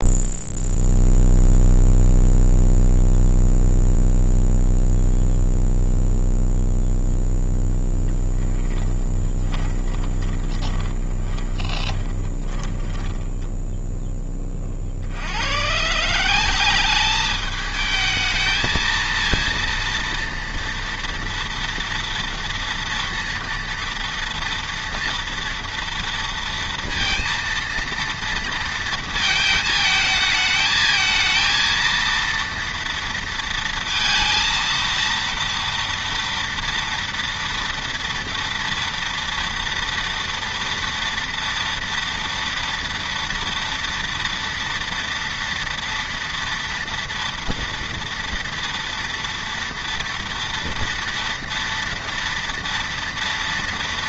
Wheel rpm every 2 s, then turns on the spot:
0, 0, 0, 0, 20, 20, 10, 30, 190, 220, 230, 230, 230, 230, 230, 220, 230, 230, 230, 230, 230, 230, 230, 230, 230, 230, 230.
8-14